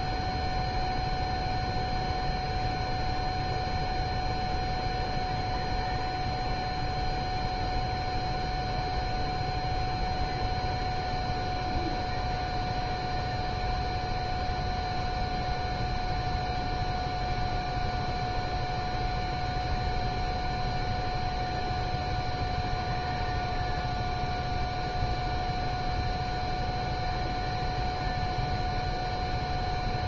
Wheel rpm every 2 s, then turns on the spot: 0, 0, 0, 0, 0, 0, 0, 0, 0, 0, 0, 0, 0, 0, 0.
none